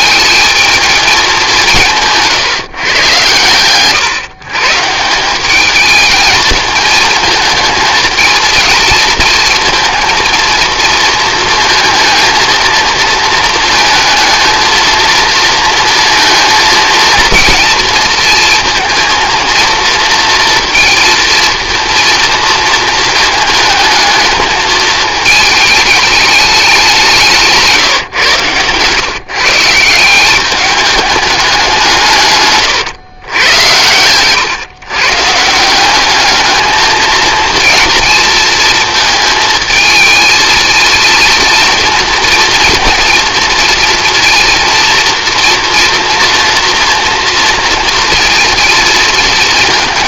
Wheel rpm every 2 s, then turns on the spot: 220, 130, 160, 220, 230, 230, 230, 230, 230, 230, 230, 230, 220, 190, 130, 210, 120, 140, 220, 230, 230, 230, 230, 230, 230.
none